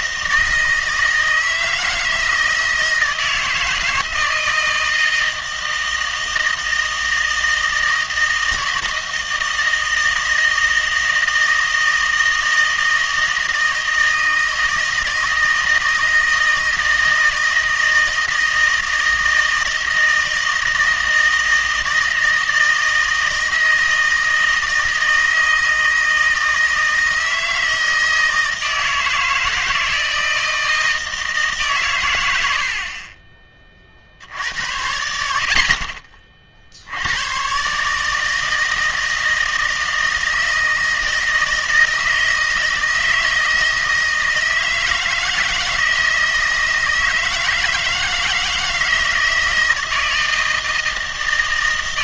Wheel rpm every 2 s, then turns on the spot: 160, 160, 160, 160, 160, 160, 160, 160, 160, 160, 160, 160, 160, 160, 160, 160, 70, 80, 60, 160, 160, 160, 160, 160, 160, 160.
none